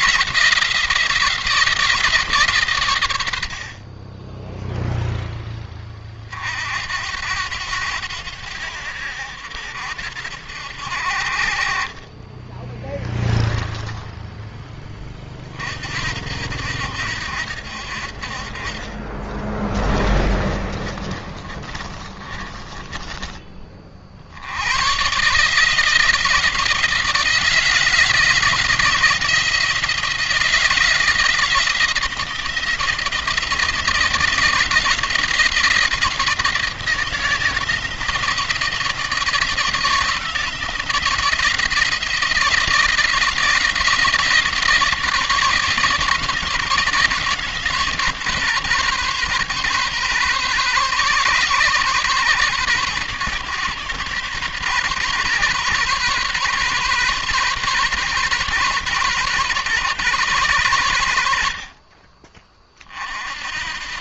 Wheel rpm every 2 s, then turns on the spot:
160, 120, 0, 60, 90, 70, 20, 20, 80, 40, 30, 20, 100, 160, 170, 160, 170, 170, 160, 160, 170, 170, 160, 160, 140, 130, 130, 140, 140, 130, 110, 40.
20-24